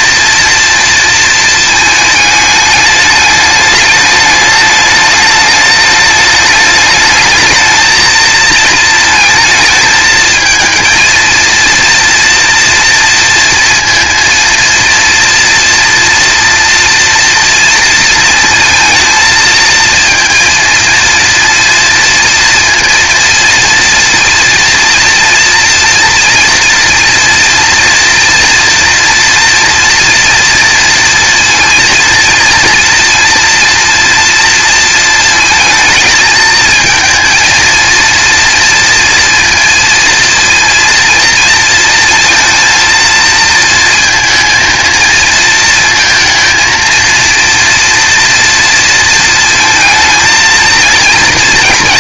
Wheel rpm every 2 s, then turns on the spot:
240, 220, 210, 210, 220, 230, 240, 230, 230, 230, 230, 230, 230, 230, 230, 230, 230, 230, 230, 230, 230, 230, 230, 230, 230, 230.
none